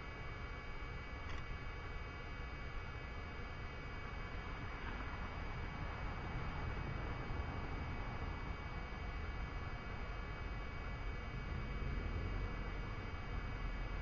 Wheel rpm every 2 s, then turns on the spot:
0, 0, 0, 0, 0, 0, 0.
none